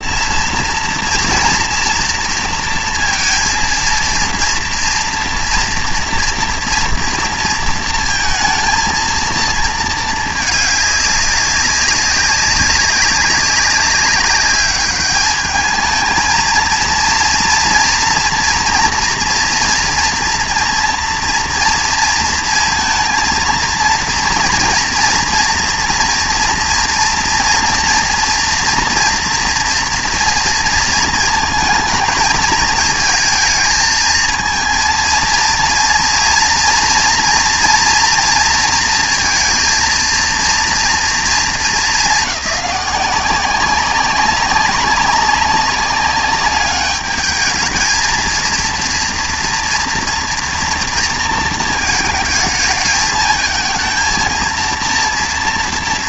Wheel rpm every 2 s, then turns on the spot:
230, 230, 230, 230, 230, 210, 200, 200, 230, 230, 230, 230, 230, 230, 230, 230, 220, 220, 230, 230, 230, 190, 190, 210, 230, 230, 220, 230.
none